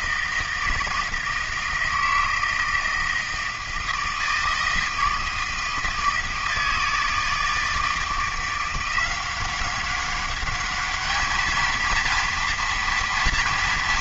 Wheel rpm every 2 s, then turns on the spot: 160, 160, 160, 160, 170, 200, 230.
none